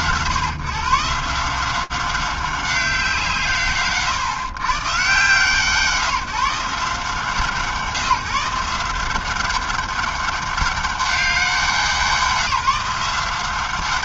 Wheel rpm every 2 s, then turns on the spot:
130, 170, 120, 150, 170, 200, 170.
none